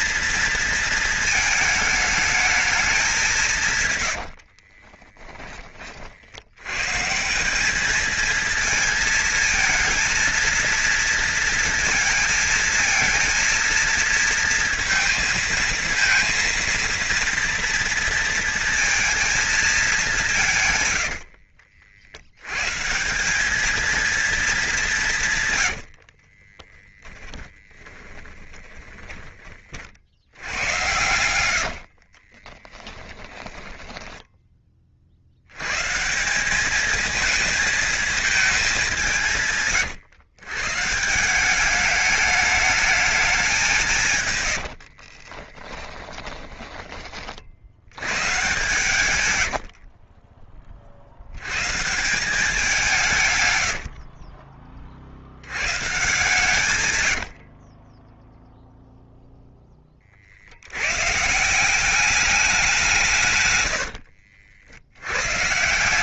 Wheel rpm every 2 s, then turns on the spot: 230, 210, 40, 120, 230, 230, 230, 230, 230, 230, 120, 140, 200, 30, 10, 90, 20, 40, 210, 190, 140, 210, 80, 30, 130, 40, 170, 40, 130, 0, 100, 180, 80.
4-6 26-34 44-46 48-50